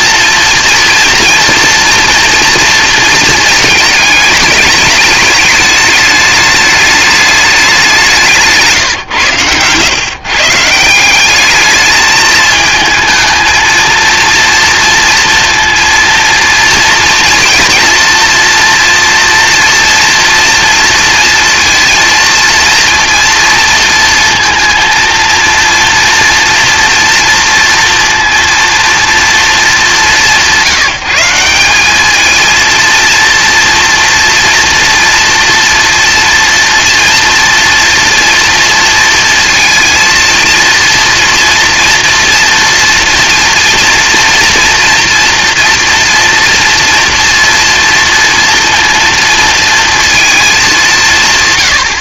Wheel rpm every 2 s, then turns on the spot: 230, 230, 210, 210, 160, 160, 220, 230, 230, 230, 230, 230, 230, 230, 230, 170, 230, 240, 240, 230, 230, 230, 230, 230, 230, 190.
none